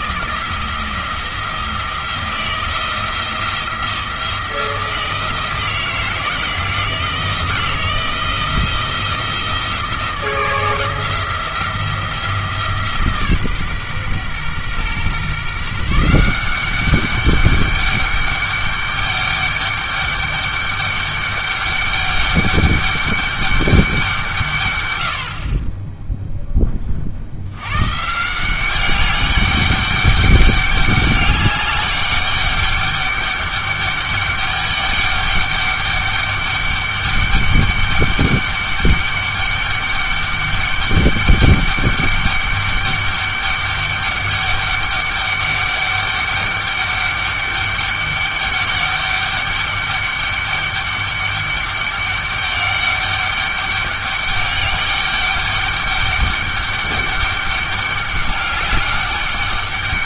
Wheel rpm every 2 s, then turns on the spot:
170, 170, 170, 170, 170, 170, 160, 130, 190, 200, 200, 200, 130, 20, 190, 200, 200, 200, 200, 200, 200, 200, 200, 200, 200, 200, 200, 200, 200, 200.
none